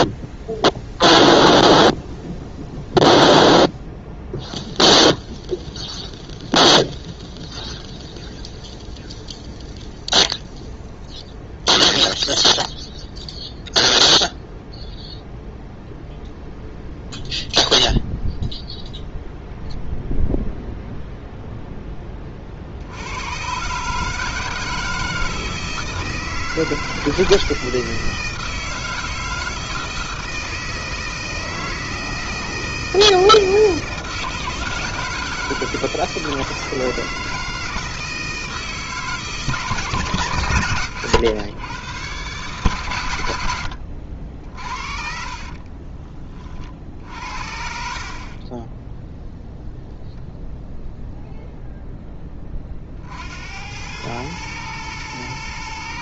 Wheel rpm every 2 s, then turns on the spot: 0, 0, 0, 0, 0, 0, 0, 0, 0, 0, 0, 50, 160, 160, 160, 160, 160, 160, 160, 160, 120, 140, 60, 40, 20, 0, 30, 110.
none